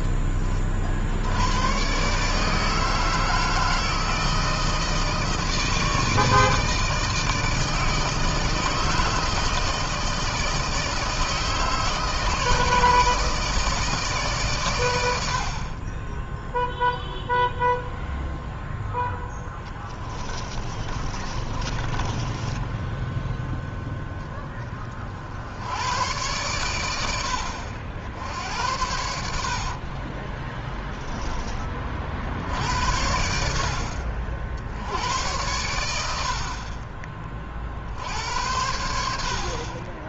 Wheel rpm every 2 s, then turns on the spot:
10, 130, 160, 160, 160, 160, 160, 150, 30, 0, 20, 30, 10, 100, 70, 40, 40, 60, 80, 60.
20-24 30-32